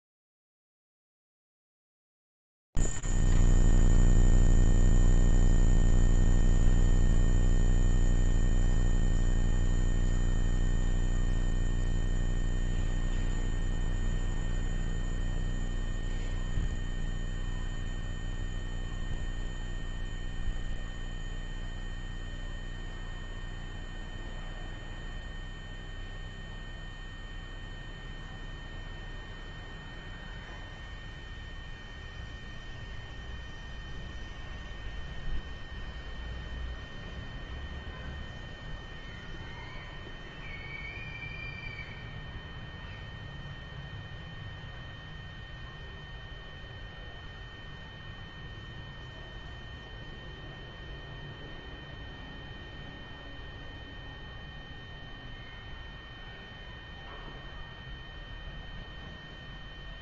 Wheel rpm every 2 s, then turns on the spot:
0, 0, 0, 0, 0, 0, 0, 0, 0, 0, 0, 0, 0, 0, 0, 0, 0, 0, 0, 0, 0, 0, 0, 0, 0, 0, 0, 0, 0, 0.
none